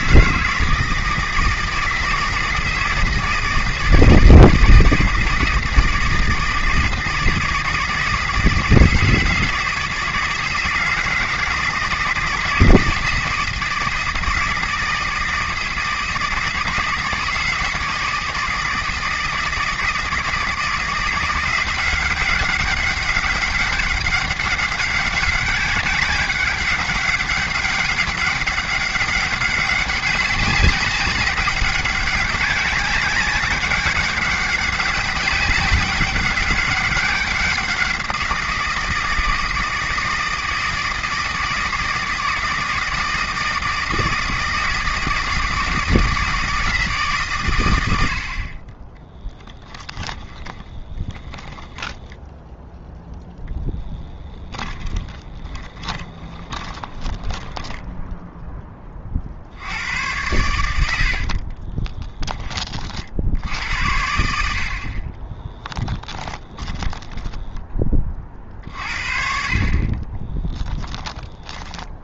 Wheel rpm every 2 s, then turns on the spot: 160, 160, 160, 160, 160, 160, 160, 160, 160, 160, 170, 200, 190, 190, 200, 190, 190, 200, 200, 170, 160, 160, 160, 160, 20, 30, 0, 20, 20, 20, 90, 40, 50, 10, 50, 10.
50-52 54-58 66-68 70-72